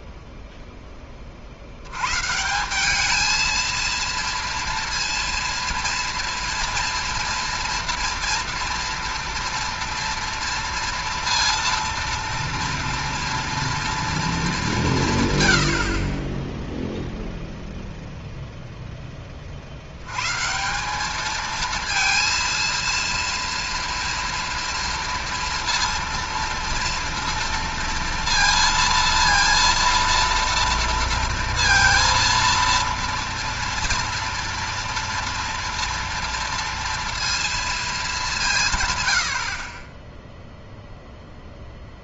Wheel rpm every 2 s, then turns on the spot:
0, 170, 230, 230, 230, 230, 230, 200, 0, 0, 170, 230, 240, 230, 230, 230, 230, 230, 230, 150, 0.
none